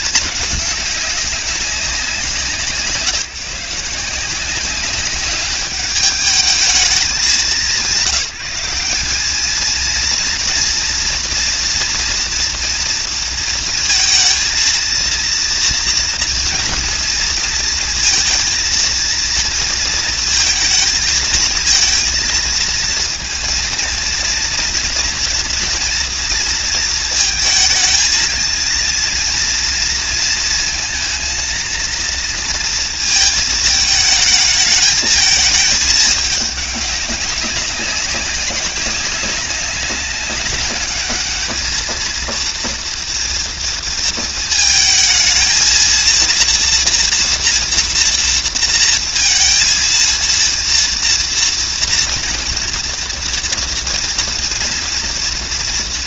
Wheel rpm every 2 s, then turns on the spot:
200, 160, 200, 200, 210, 230, 230, 230, 230, 230, 220, 230, 230, 230, 230, 230, 220, 220, 200, 190, 210, 230, 220, 230, 230, 230, 230, 240.
none